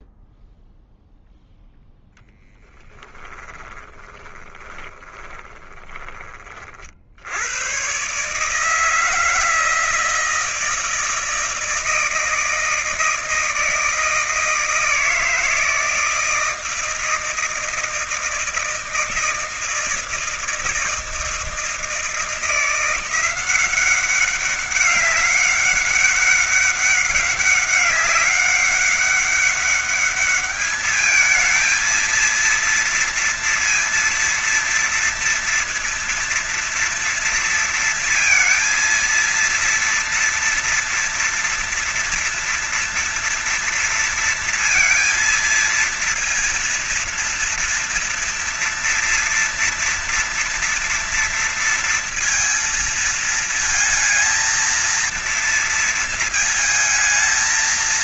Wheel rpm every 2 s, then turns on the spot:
0, 0, 20, 50, 150, 160, 160, 160, 160, 160, 160, 170, 190, 190, 200, 210, 230, 230, 230, 230, 230, 240, 230, 230, 230, 240, 230, 230, 230.
4-6